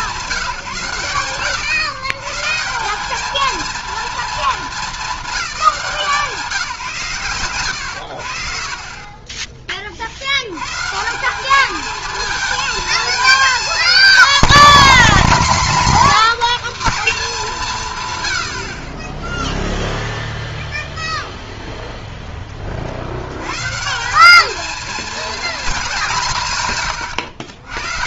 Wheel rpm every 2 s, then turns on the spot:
140, 220, 170, 70, 60, 220, 250, 270, 130, 0, 0, 170, 200, 150.
none